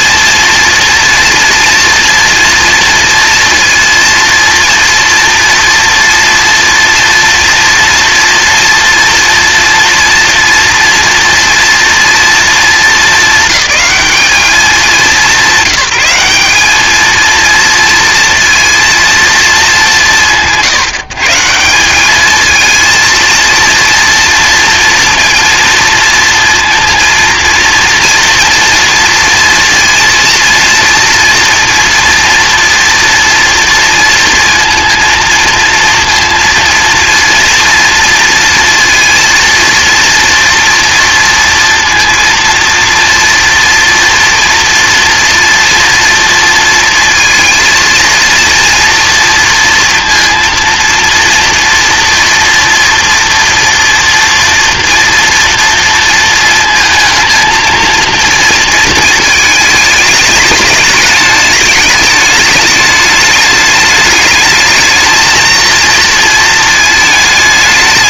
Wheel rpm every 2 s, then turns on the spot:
230, 230, 230, 230, 230, 230, 220, 210, 200, 230, 160, 220, 230, 230, 230, 230, 230, 230, 230, 230, 230, 230, 230, 230, 230, 230, 240, 230, 230, 230, 210, 210, 220, 220.
none